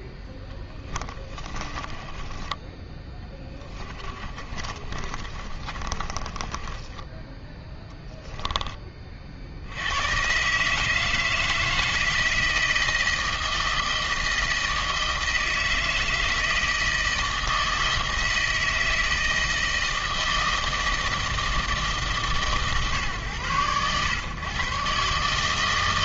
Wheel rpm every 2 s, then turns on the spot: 10, 20, 30, 20, 10, 140, 160, 160, 160, 160, 160, 140, 120.
0-8